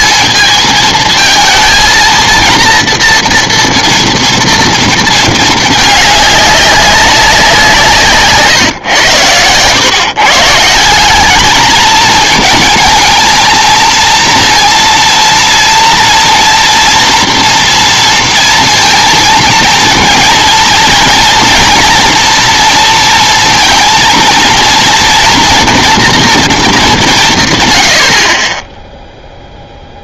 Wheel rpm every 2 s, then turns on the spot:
230, 230, 210, 160, 130, 220, 230, 230, 230, 230, 230, 230, 230, 100, 0.
none